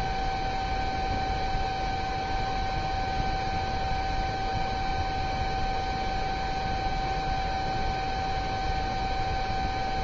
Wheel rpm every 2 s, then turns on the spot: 0, 0, 0, 0, 0.
none